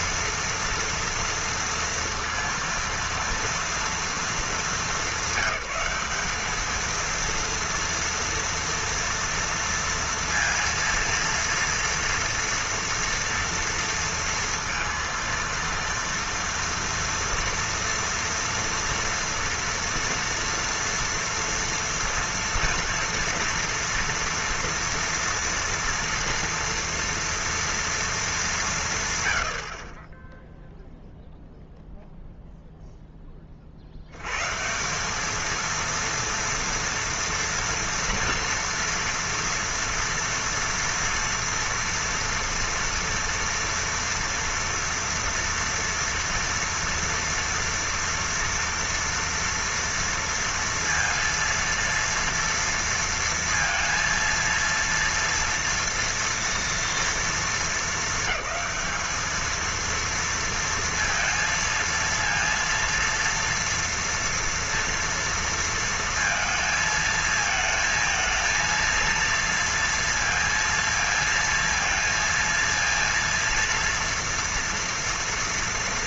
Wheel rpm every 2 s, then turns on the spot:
230, 230, 210, 220, 230, 230, 230, 230, 230, 240, 230, 240, 230, 230, 170, 0, 0, 170, 230, 230, 230, 230, 230, 230, 230, 230, 230, 230, 230, 210, 230, 230, 230, 230, 230, 230, 230, 230.
none